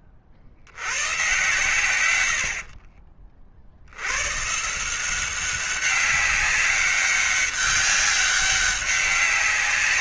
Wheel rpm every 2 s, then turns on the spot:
90, 60, 160, 200, 190.
none